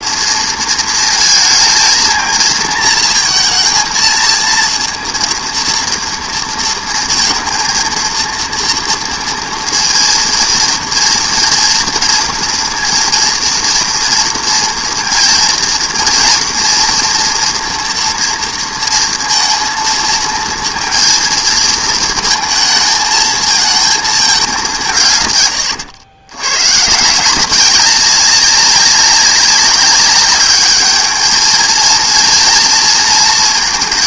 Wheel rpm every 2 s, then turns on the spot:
230, 230, 230, 230, 230, 230, 230, 230, 230, 230, 230, 220, 180, 110, 190, 210, 230.
none